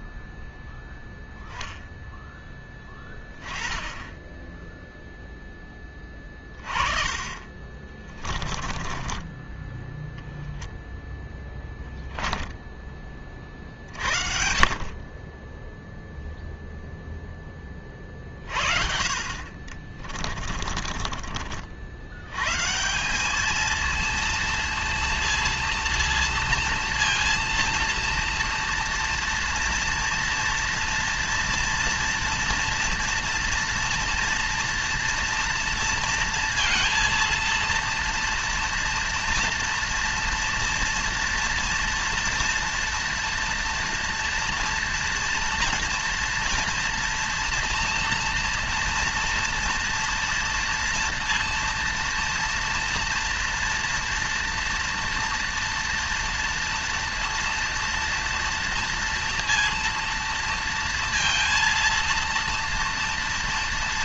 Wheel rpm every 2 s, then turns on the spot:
0, 10, 10, 20, 20, 20, 10, 60, 0, 50, 40, 120, 230, 230, 230, 230, 230, 230, 230, 230, 230, 230, 230, 240, 230, 230, 230, 230, 230, 240, 230, 230.
8-10 20-22